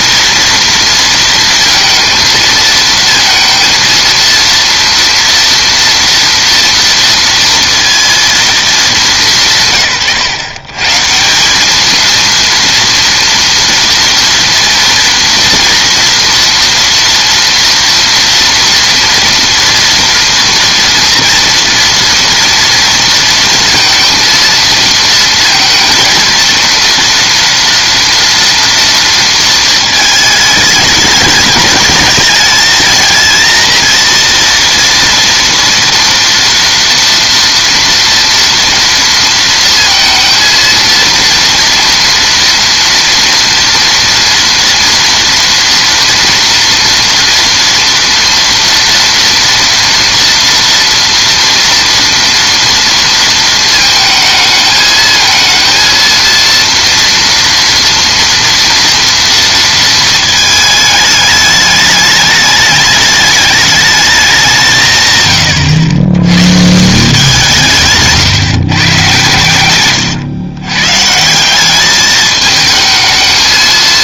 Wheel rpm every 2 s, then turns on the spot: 230, 220, 230, 230, 210, 120, 230, 230, 230, 230, 230, 230, 230, 230, 230, 210, 220, 230, 230, 230, 230, 230, 230, 230, 230, 230, 230, 220, 230, 230, 220, 210, 180, 140, 150, 120, 220.
none